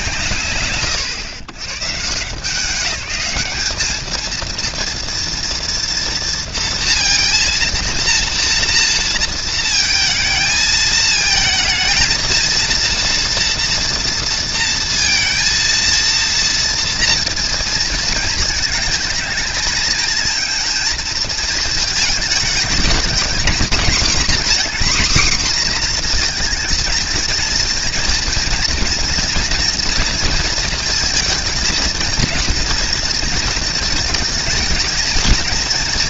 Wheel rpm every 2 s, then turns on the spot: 130, 210, 230, 230, 230, 220, 230, 230, 230, 220, 220, 240, 250, 230, 230, 220, 230, 190.
none